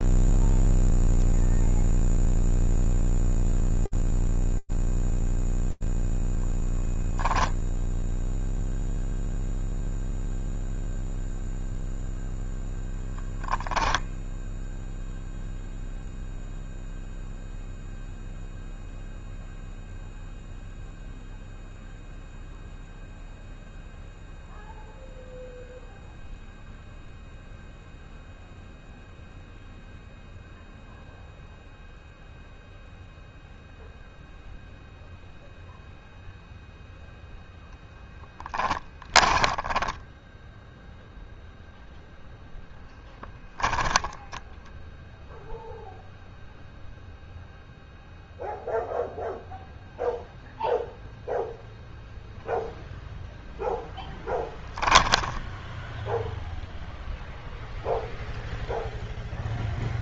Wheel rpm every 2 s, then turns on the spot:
0, 0, 0, 0, 0, 0, 10, 0, 0, 0, 0, 0, 0, 0, 0, 0, 0, 0, 0, 20, 0, 0, 0, 0, 0, 0, 0, 10, 0, 0.
38-40 54-56